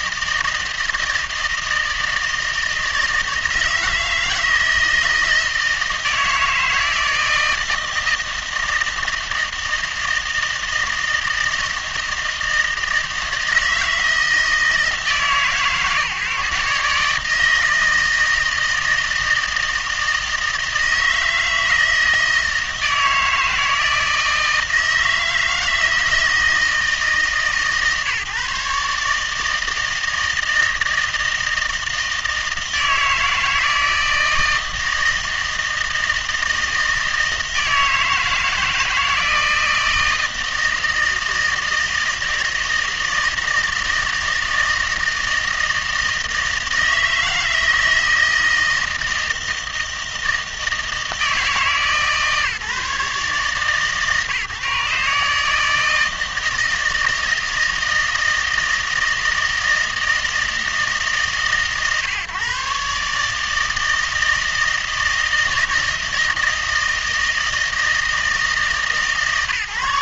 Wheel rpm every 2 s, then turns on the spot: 160, 160, 160, 160, 160, 160, 160, 160, 140, 160, 160, 160, 160, 160, 140, 160, 160, 160, 160, 160, 160, 160, 160, 160, 160, 160, 150, 150, 160, 160, 160, 140, 160, 160, 160.
none